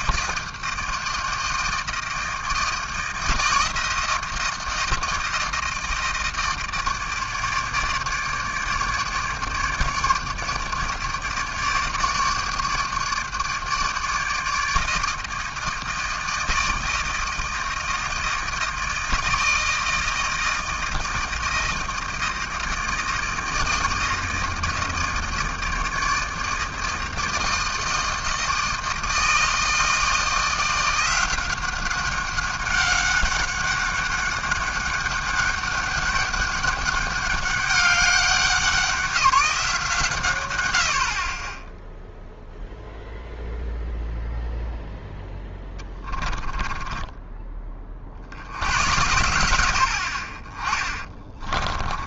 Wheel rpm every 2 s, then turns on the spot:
160, 160, 160, 160, 150, 150, 150, 160, 160, 160, 160, 160, 160, 160, 160, 170, 190, 200, 200, 190, 110, 0, 0, 10, 70, 30.
46-48